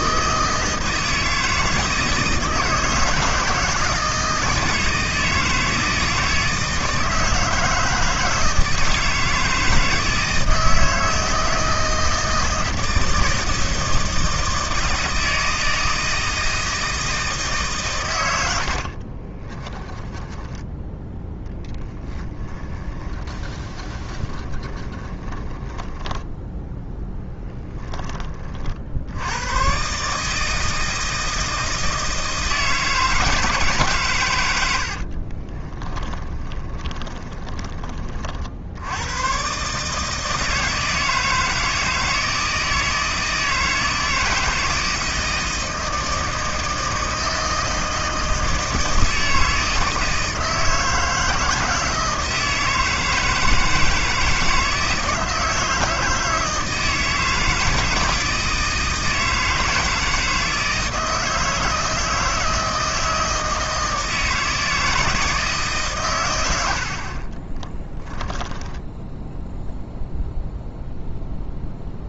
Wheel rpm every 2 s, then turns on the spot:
160, 160, 160, 160, 160, 160, 160, 160, 160, 60, 10, 20, 20, 0, 60, 160, 160, 70, 20, 90, 160, 160, 160, 160, 160, 160, 160, 160, 160, 160, 160, 160, 160, 60, 10, 0.
18-26 34-38 68-70